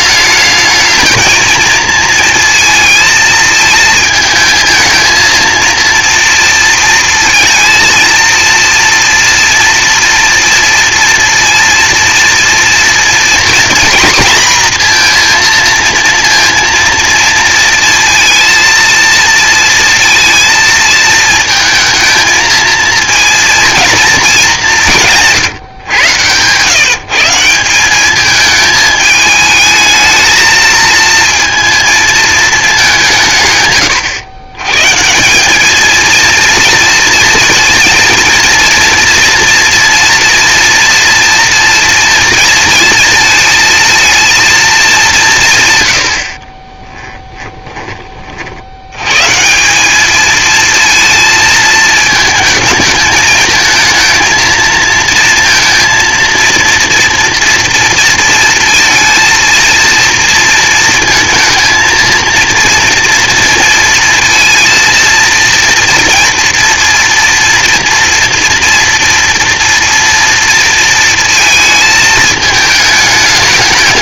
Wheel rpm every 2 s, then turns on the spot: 220, 230, 220, 240, 240, 230, 230, 230, 230, 230, 220, 220, 210, 130, 210, 220, 210, 130, 230, 230, 230, 230, 220, 30, 60, 220, 220, 230, 230, 230, 230, 230, 230, 230, 230, 230, 220.
46-48